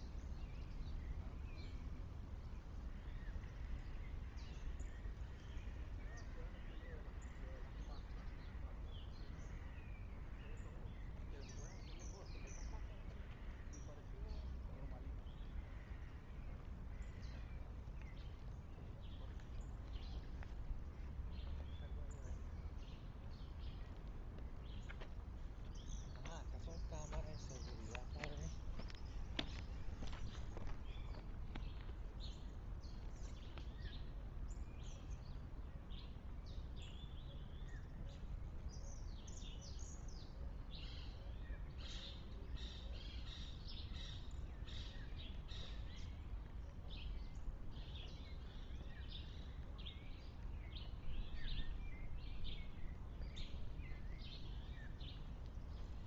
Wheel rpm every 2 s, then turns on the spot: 0, 0, 0, 0, 0, 0, 0, 0, 0, 0, 0, 0, 0, 0, 0, 0, 0, 0, 0, 0, 0, 0, 0, 0, 0, 0, 0, 0.
none